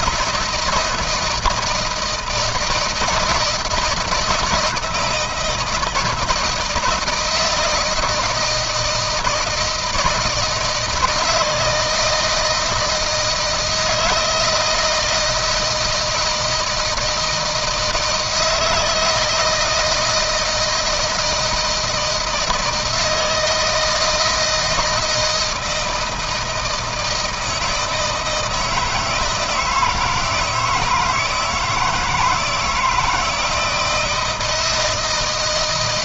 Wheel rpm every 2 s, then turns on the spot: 170, 160, 160, 170, 160, 160, 160, 160, 160, 160, 160, 160, 160, 160, 160, 160, 160, 160.
none